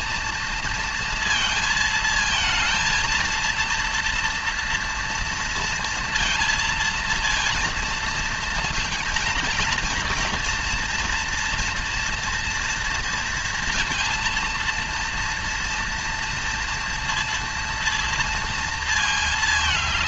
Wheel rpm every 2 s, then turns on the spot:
230, 220, 230, 230, 230, 230, 230, 230, 230, 230.
none